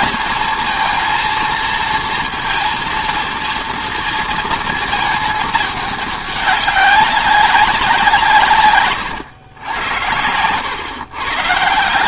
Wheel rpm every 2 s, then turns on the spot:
230, 230, 230, 200, 140, 110.
none